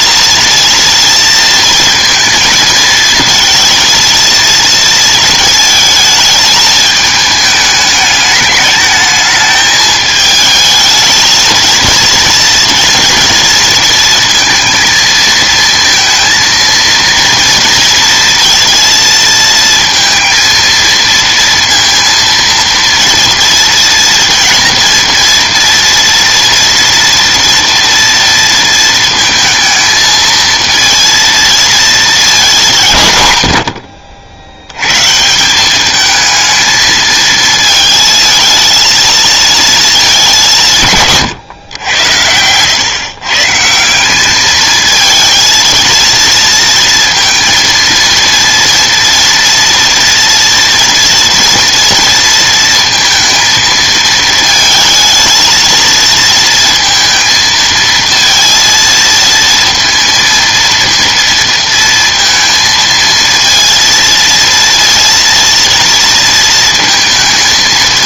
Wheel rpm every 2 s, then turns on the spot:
230, 230, 230, 220, 210, 220, 230, 230, 230, 230, 230, 230, 230, 230, 230, 230, 190, 80, 220, 230, 180, 100, 210, 230, 230, 230, 230, 220, 230, 230, 230, 220, 230, 230.
none